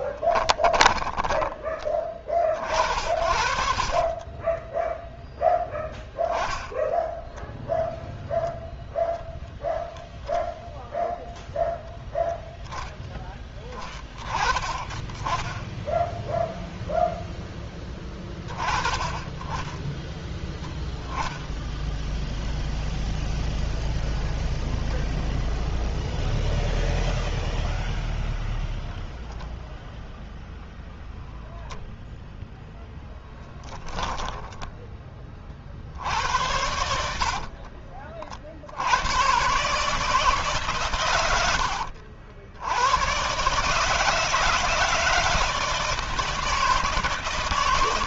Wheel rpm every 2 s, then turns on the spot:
10, 50, 10, 10, 10, 0, 10, 30, 0, 30, 10, 0, 0, 0, 0, 0, 0, 10, 80, 60, 150, 80, 160, 160.
0-2 6-8 34-36